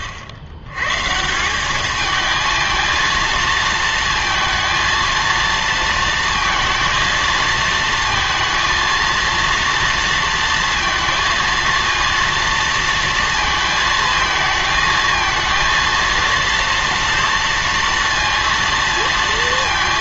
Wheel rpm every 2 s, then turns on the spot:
110, 220, 230, 230, 230, 230, 230, 220, 230, 230.
none